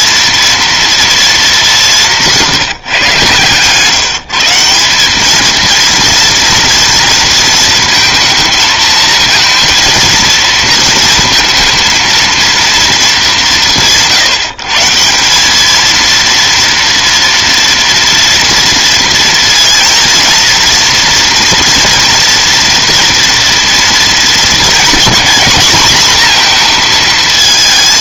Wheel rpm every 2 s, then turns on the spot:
230, 170, 170, 230, 220, 230, 230, 160, 230, 230, 240, 240, 240, 240.
none